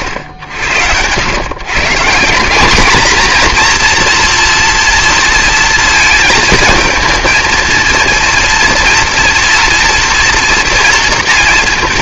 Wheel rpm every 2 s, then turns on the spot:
100, 210, 240, 220, 230, 230.
none